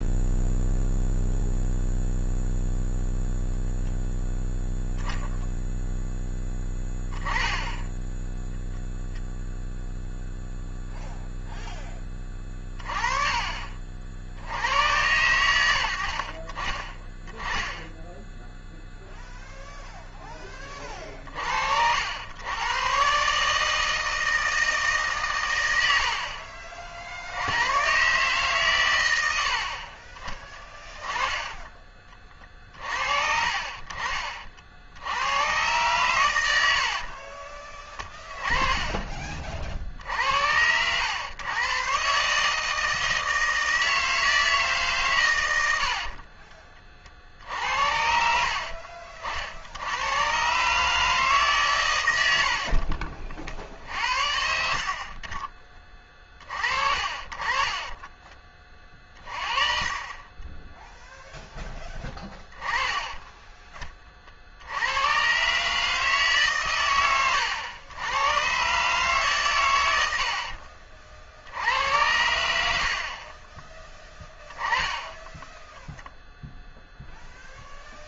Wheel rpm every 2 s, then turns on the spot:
0, 0, 0, 10, 0, 0, 30, 90, 30, 0, 30, 120, 140, 50, 120, 20, 50, 70, 60, 20, 100, 160, 140, 40, 50, 150, 50, 50, 40, 30, 0, 20, 90, 90, 130, 40, 70, 10, 0.
32-34 36-38 52-54